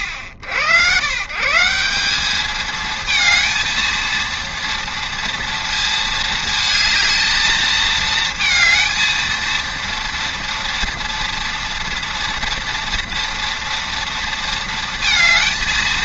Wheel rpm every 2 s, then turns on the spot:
90, 220, 230, 220, 230, 230, 230, 230.
none